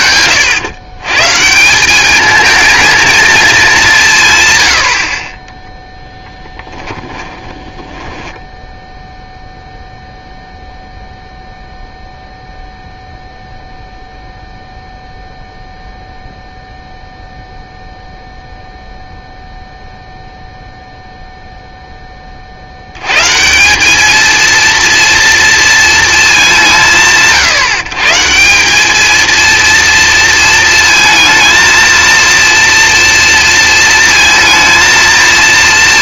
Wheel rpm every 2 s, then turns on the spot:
120, 220, 110, 10, 10, 0, 0, 0, 0, 0, 0, 60, 230, 180, 200, 230, 230, 230.
6-8